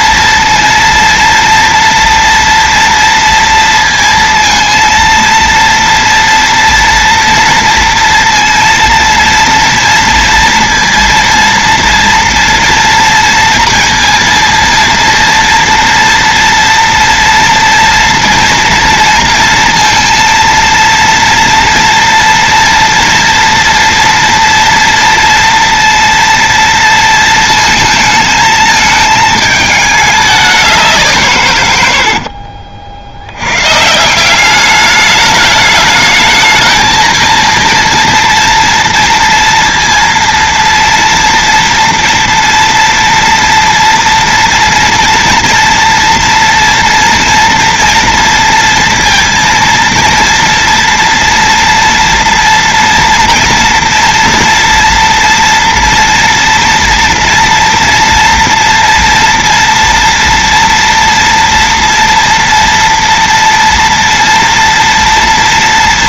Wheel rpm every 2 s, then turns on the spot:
230, 230, 230, 230, 230, 230, 230, 230, 230, 230, 230, 230, 230, 230, 220, 200, 60, 190, 210, 230, 230, 230, 240, 240, 230, 230, 240, 230, 230, 230, 230, 240, 240.
32-34